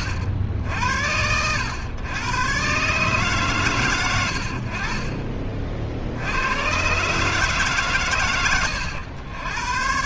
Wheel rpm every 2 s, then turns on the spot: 70, 120, 50, 110, 100.
none